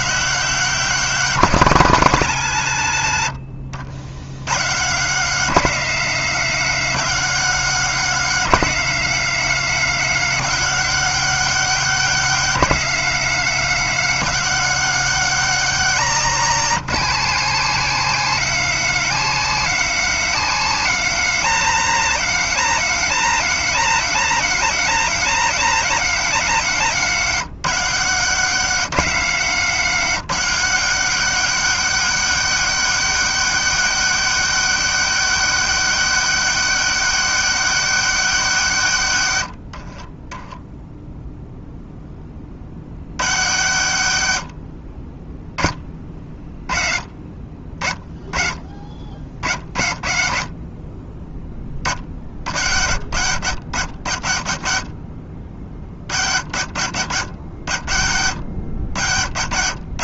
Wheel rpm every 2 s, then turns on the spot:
190, 130, 130, 180, 180, 190, 190, 190, 180, 190, 180, 190, 190, 170, 170, 180, 200, 200, 200, 160, 10, 70, 30, 30, 40, 30, 80, 50, 80, 90.
40-42